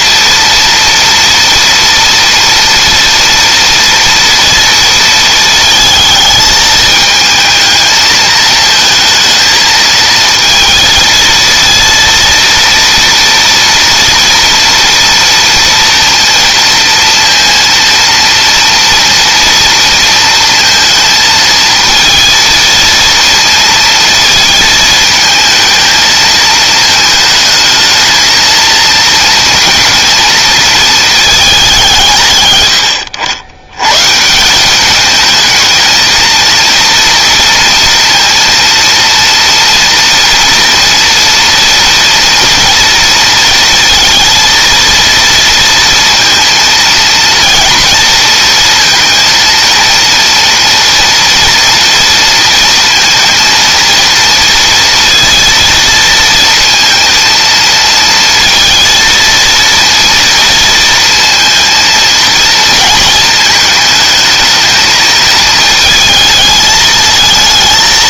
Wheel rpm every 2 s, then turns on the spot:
230, 230, 230, 220, 220, 230, 230, 230, 230, 230, 220, 230, 220, 220, 220, 220, 90, 210, 230, 230, 230, 230, 230, 230, 230, 230, 230, 230, 230, 220, 230, 220, 220, 220.
none